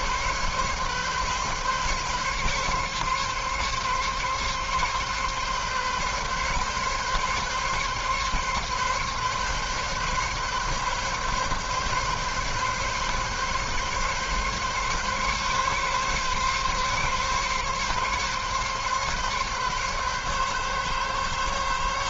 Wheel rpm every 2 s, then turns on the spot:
140, 140, 140, 140, 140, 140, 140, 140, 140, 140, 140.
none